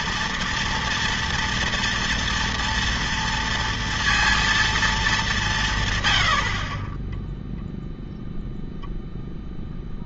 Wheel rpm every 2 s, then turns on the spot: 230, 230, 230, 40, 0.
none